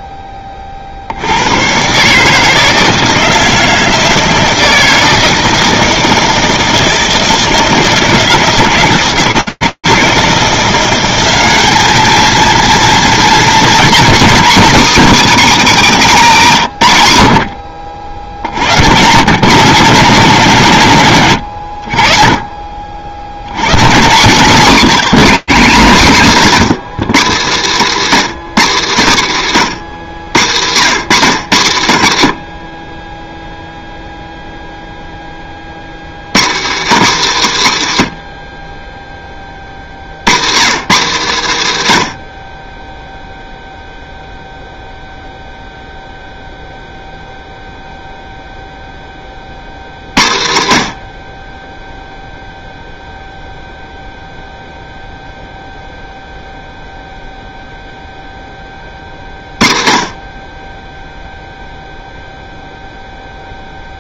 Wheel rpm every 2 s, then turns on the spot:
0, 130, 160, 160, 160, 170, 220, 230, 200, 70, 150, 50, 160, 220, 210, 160, 50, 0, 210, 40, 190, 30, 0, 0, 0, 80, 0, 0, 0, 30, 20, 0.
32-34 38-40